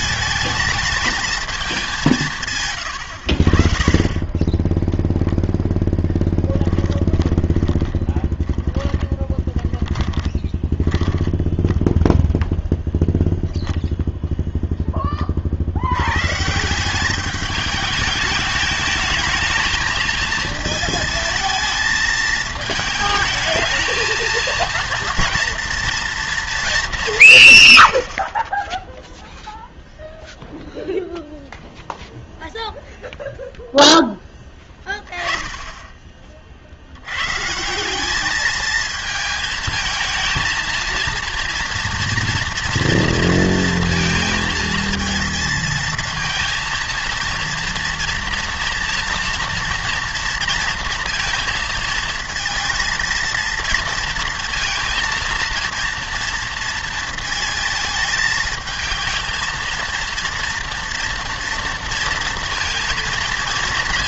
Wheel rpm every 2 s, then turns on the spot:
220, 130, 10, 10, 20, 20, 0, 0, 160, 210, 220, 220, 230, 220, 10, 0, 0, 20, 50, 220, 230, 230, 230, 230, 230, 230, 230, 230, 230, 220, 230, 230.
2-12